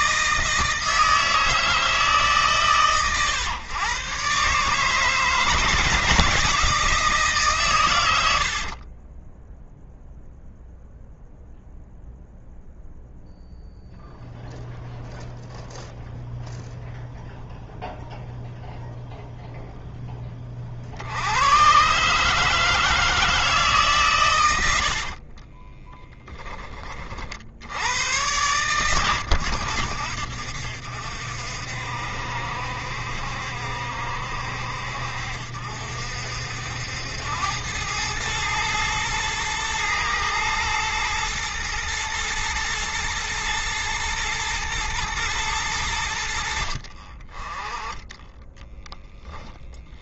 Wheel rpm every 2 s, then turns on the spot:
160, 120, 160, 160, 30, 0, 0, 0, 0, 0, 70, 160, 50, 40, 90, 60, 70, 60, 80, 110, 120, 110, 110, 40, 10.
8-10 24-26 48-50